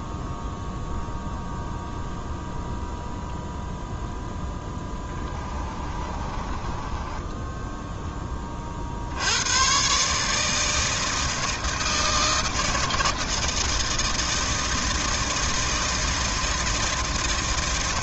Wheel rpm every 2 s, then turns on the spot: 0, 0, 0, 20, 40, 160, 160, 160, 160.
6-8